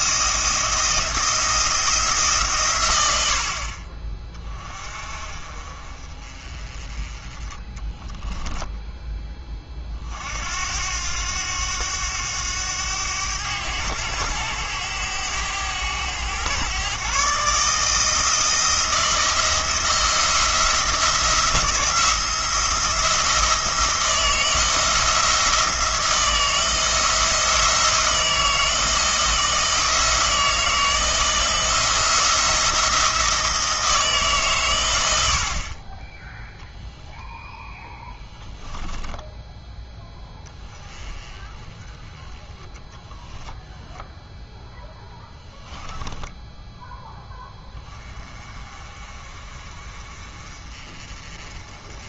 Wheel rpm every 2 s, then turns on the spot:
170, 120, 30, 30, 10, 90, 100, 100, 120, 170, 170, 170, 160, 170, 160, 160, 170, 110, 0, 10, 10, 10, 0, 10, 30, 30.
38-40